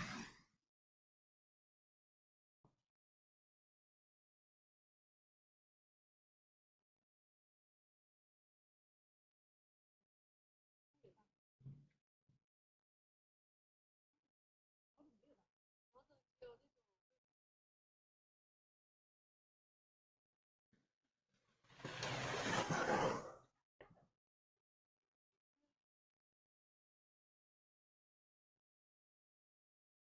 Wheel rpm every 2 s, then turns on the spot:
0, 0, 0, 0, 0, 0, 0, 0, 0, 0, 0, 0, 0, 0, 0.
none